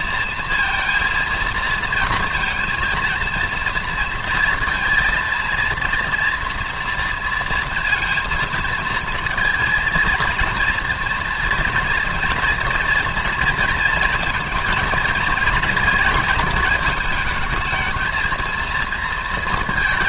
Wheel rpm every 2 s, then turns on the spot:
230, 230, 230, 230, 230, 230, 230, 230, 220, 230.
none